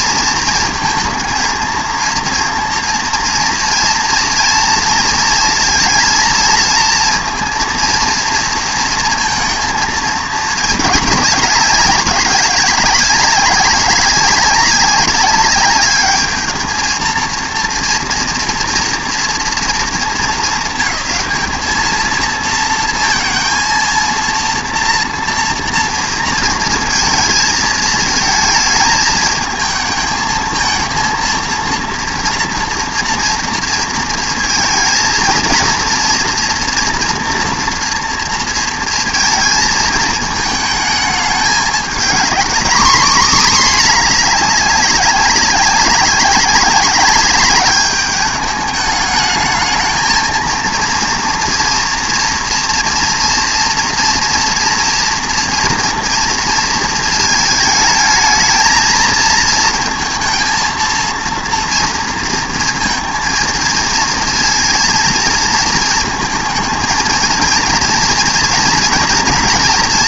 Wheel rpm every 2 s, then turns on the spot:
230, 230, 230, 220, 230, 210, 200, 200, 220, 240, 210, 230, 230, 230, 220, 230, 240, 230, 240, 230, 220, 240, 200, 200, 210, 230, 230, 230, 230, 220, 230, 230, 230, 230, 230.
none